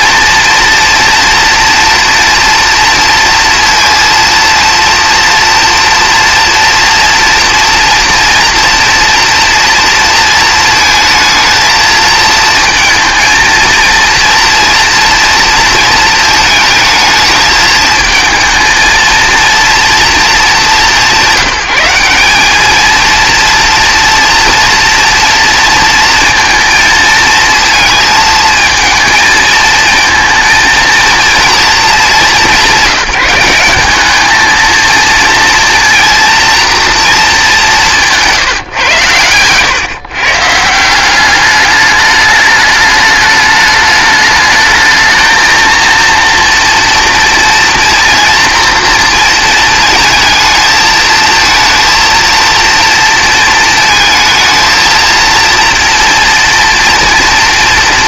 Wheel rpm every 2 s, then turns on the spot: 240, 230, 230, 230, 230, 220, 230, 230, 220, 220, 200, 200, 230, 230, 220, 230, 190, 220, 240, 150, 160, 210, 220, 240, 230, 220, 230, 230, 230.
38-40